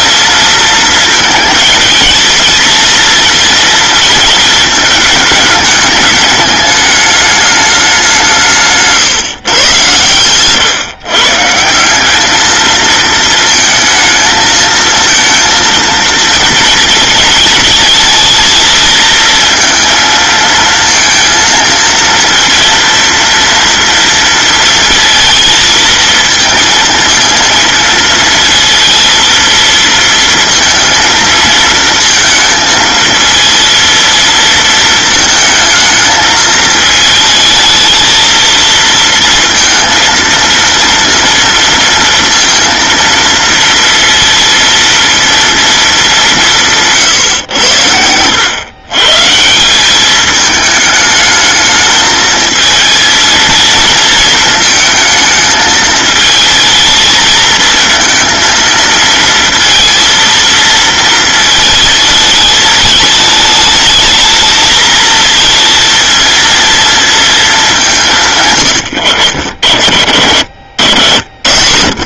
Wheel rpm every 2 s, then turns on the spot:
230, 230, 220, 210, 160, 130, 220, 220, 230, 220, 230, 230, 230, 230, 230, 230, 230, 230, 220, 220, 230, 230, 230, 180, 100, 210, 220, 230, 220, 230, 230, 210, 220, 230, 110, 80.
none